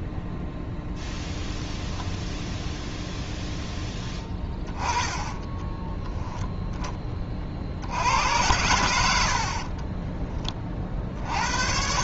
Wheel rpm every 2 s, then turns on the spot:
0, 0, 10, 10, 100, 30.
4-6